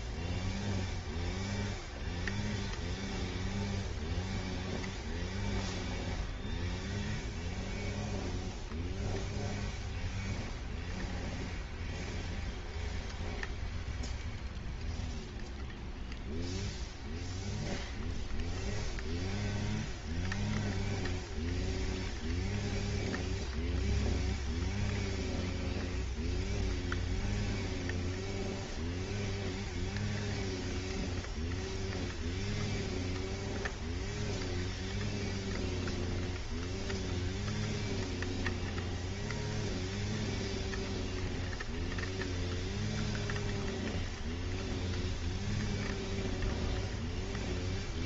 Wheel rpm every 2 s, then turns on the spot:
0, 0, 0, 0, 0, 0, 0, 0, 0, 0, 0, 0, 0, 0, 0, 0, 0, 0, 0, 0, 0, 0, 0, 0.
none